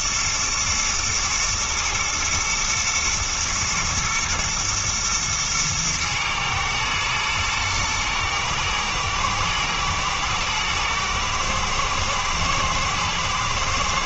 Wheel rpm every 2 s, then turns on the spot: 120, 120, 110, 110, 110, 120, 120.
none